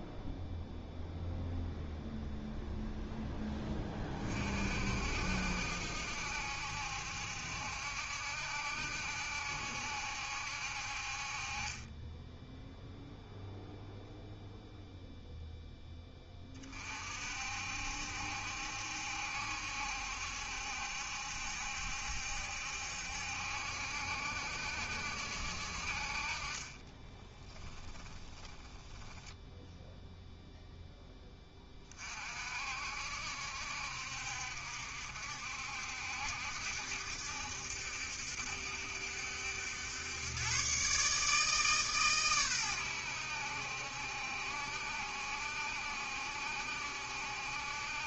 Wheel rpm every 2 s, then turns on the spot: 0, 0, 50, 70, 70, 60, 0, 0, 30, 70, 70, 70, 70, 30, 10, 0, 60, 60, 70, 70, 120, 110, 70, 70.
26-30